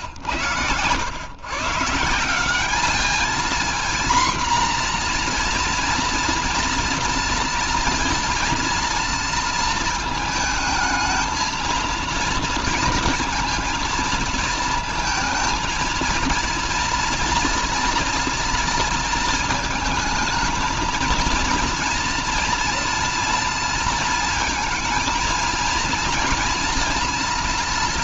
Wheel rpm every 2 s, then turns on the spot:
100, 200, 240, 230, 230, 220, 230, 230, 230, 230, 230, 230, 230, 240.
none